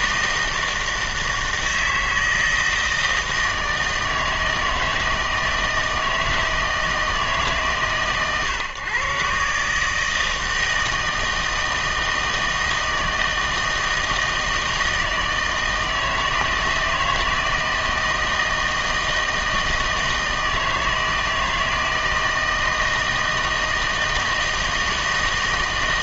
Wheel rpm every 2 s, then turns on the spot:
160, 160, 160, 160, 130, 160, 160, 160, 160, 160, 160, 160, 160.
none